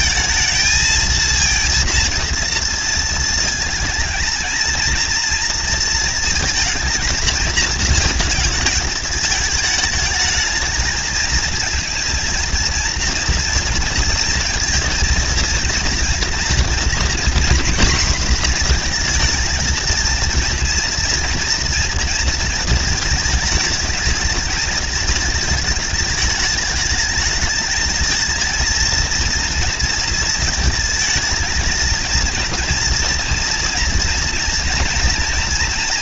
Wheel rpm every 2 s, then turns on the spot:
220, 230, 220, 230, 220, 220, 230, 240, 230, 230, 230, 230, 220, 210, 230, 230, 230, 230.
none